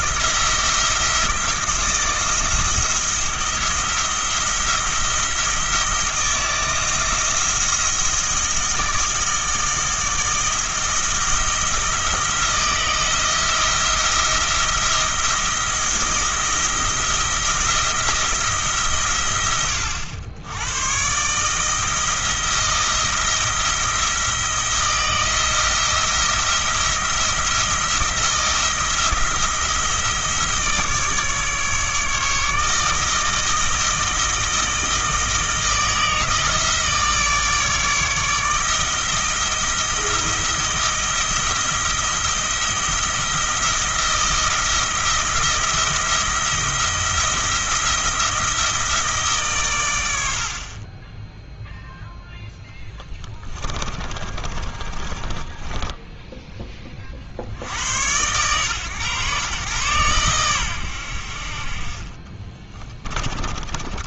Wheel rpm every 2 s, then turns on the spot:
170, 160, 170, 170, 160, 160, 170, 170, 170, 140, 100, 170, 170, 170, 170, 160, 160, 160, 160, 160, 170, 170, 170, 170, 160, 40, 10, 30, 10, 120, 100, 20.
52-56 62-64